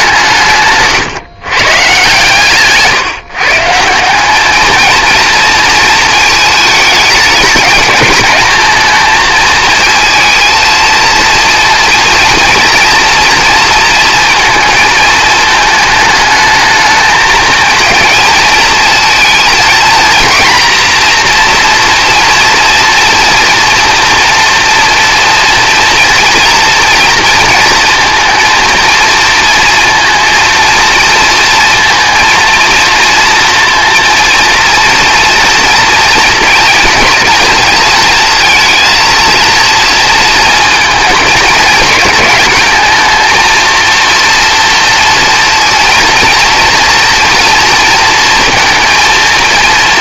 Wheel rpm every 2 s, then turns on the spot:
140, 150, 230, 210, 220, 230, 230, 220, 220, 230, 230, 230, 230, 230, 230, 230, 230, 230, 220, 230, 220, 220, 230, 230, 230.
none